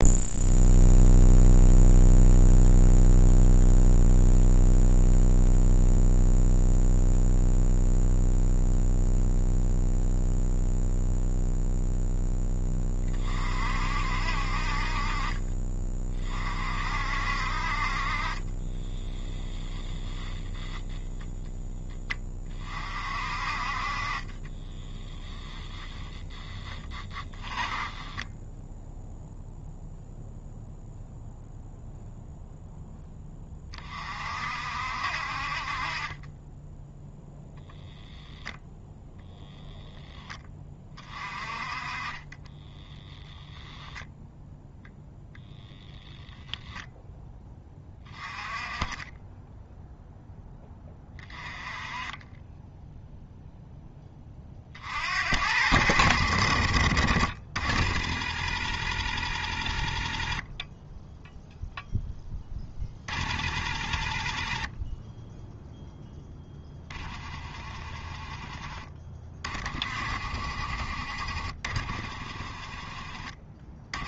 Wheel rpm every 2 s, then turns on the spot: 0, 0, 0, 0, 0, 0, 20, 50, 50, 20, 0, 30, 10, 10, 10, 0, 0, 60, 10, 0, 20, 20, 0, 0, 20, 10, 10, 50, 50, 60, 20, 20, 20, 20, 20, 50, 30.
18-20 24-30 42-44 68-70